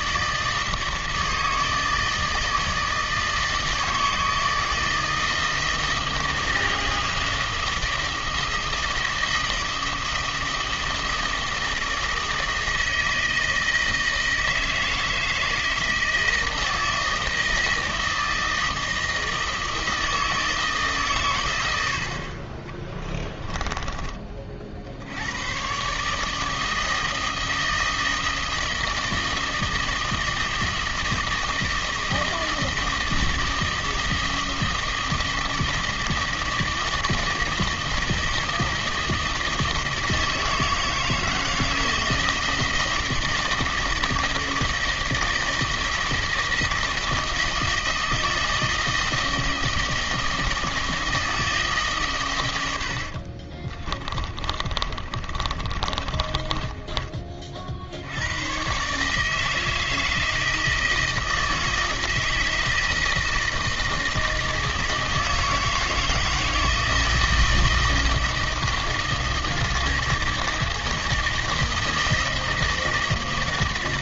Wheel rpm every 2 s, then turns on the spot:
160, 160, 160, 160, 160, 160, 160, 160, 160, 160, 150, 20, 60, 160, 160, 160, 160, 160, 160, 160, 160, 160, 160, 160, 160, 160, 90, 30, 20, 130, 160, 160, 160, 160, 160, 160, 160.
22-24 54-58